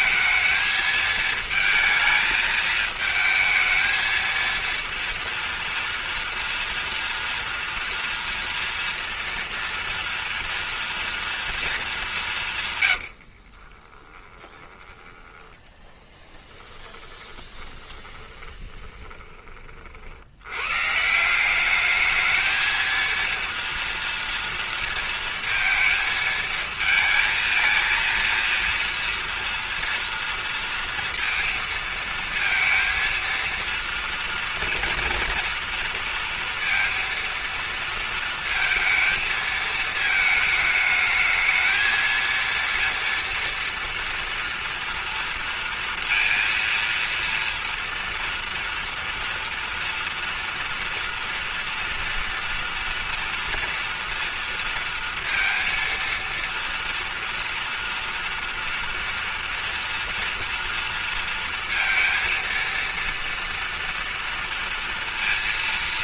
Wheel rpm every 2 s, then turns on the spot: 220, 220, 230, 240, 230, 230, 120, 10, 20, 20, 130, 230, 230, 230, 230, 230, 230, 230, 230, 230, 210, 230, 230, 230, 230, 240, 230, 230, 230, 230, 240, 230, 230.
12-14 16-20